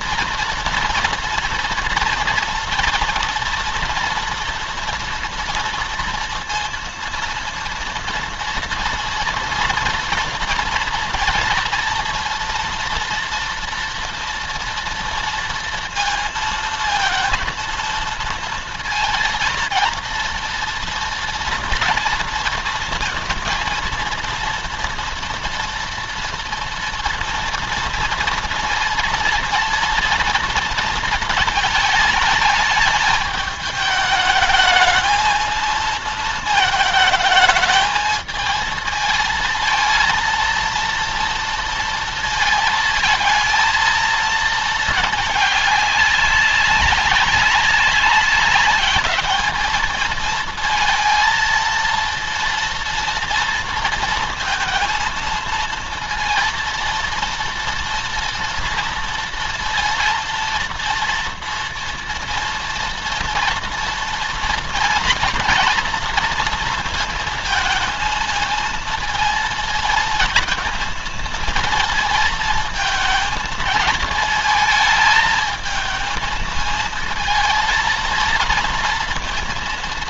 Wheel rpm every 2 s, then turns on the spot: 230, 230, 230, 230, 230, 230, 230, 230, 230, 230, 230, 230, 230, 230, 230, 230, 210, 220, 220, 220, 230, 230, 220, 200, 200, 220, 230, 220, 230, 240, 230, 230, 230, 230, 220, 230, 230, 220, 220, 230.
none